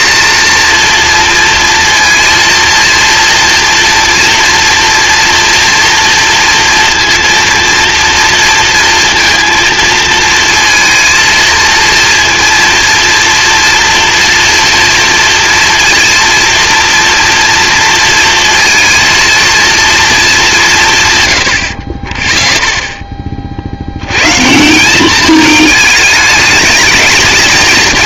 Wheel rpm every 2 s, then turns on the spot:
230, 230, 230, 230, 230, 230, 240, 240, 230, 230, 190, 10, 150, 220.
none